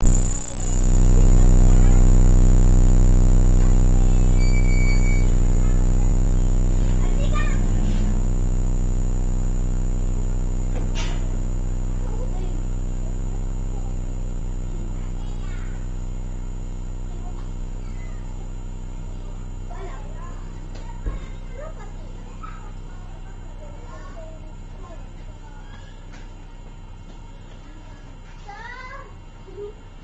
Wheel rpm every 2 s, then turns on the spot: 0, 0, 0, 0, 0, 0, 0, 0, 0, 0, 0, 0, 0, 0, 0.
none